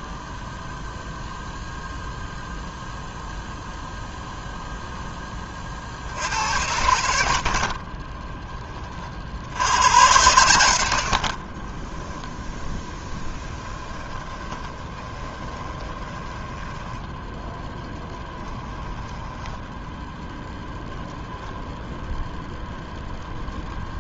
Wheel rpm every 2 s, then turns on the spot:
0, 0, 0, 90, 20, 90, 10, 20, 10, 10, 0, 0.
12-20